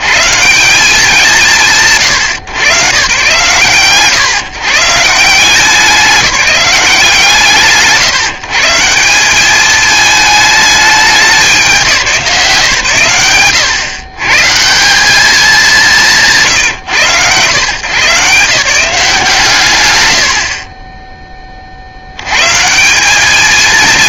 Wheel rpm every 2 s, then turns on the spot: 110, 110, 130, 190, 150, 220, 160, 130, 180, 130, 80, 110.
none